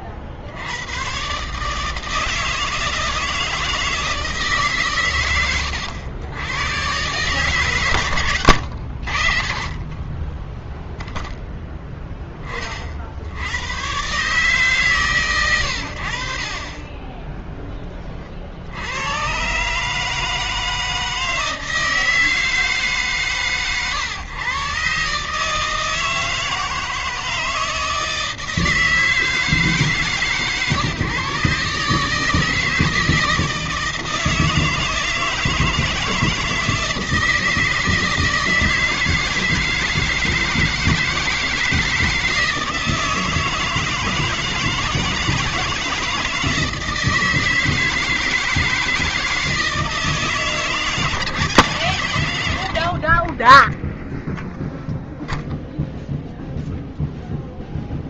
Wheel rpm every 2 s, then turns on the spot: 70, 160, 150, 110, 110, 20, 20, 130, 20, 70, 160, 150, 120, 160, 160, 130, 160, 160, 160, 160, 160, 160, 160, 160, 160, 160, 100, 0, 0.
none